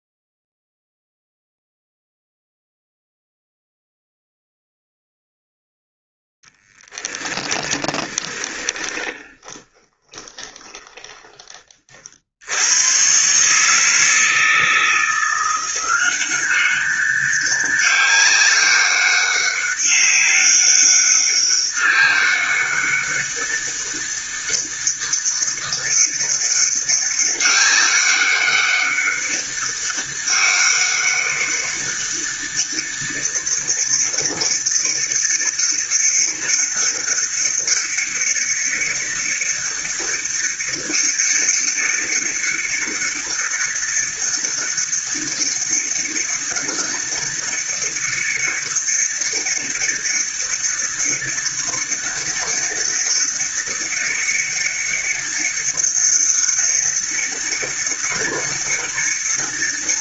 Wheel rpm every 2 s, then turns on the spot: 0, 0, 0, 10, 20, 20, 140, 170, 200, 200, 200, 200, 200, 200, 200, 200, 200, 200, 200, 200, 200, 200, 200, 200, 200, 200, 200, 200, 190, 200.
6-10